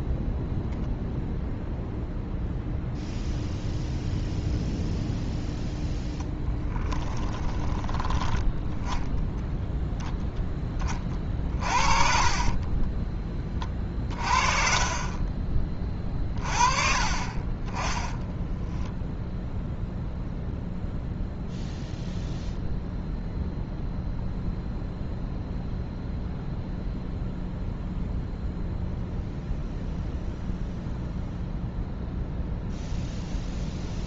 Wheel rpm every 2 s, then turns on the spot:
0, 0, 0, 10, 10, 10, 20, 30, 40, 10, 0, 0, 0, 0, 0, 0, 0.
6-8 12-14